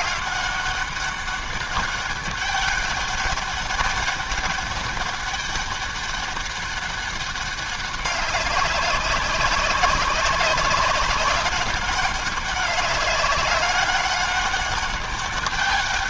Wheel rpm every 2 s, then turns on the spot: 200, 200, 200, 200, 190, 190, 200, 200.
none